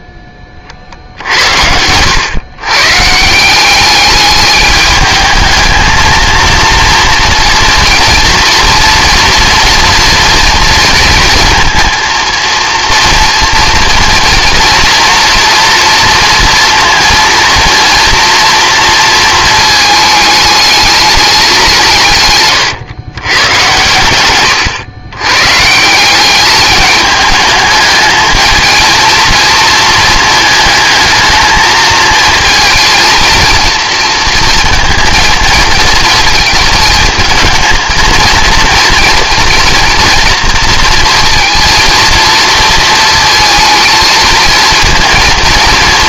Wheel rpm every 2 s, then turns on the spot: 50, 140, 210, 230, 230, 230, 230, 230, 230, 230, 210, 120, 110, 210, 220, 220, 230, 230, 220, 230, 230, 220, 230.
none